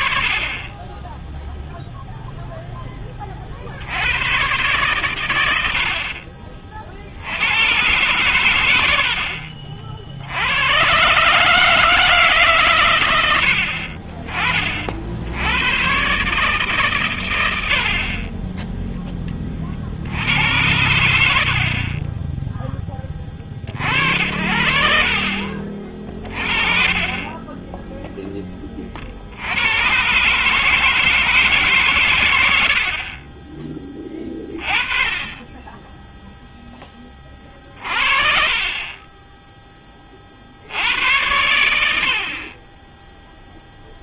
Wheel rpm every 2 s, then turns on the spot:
30, 0, 120, 50, 100, 110, 120, 60, 120, 0, 80, 30, 60, 30, 50, 160, 30, 30, 20, 30, 70, 20.
none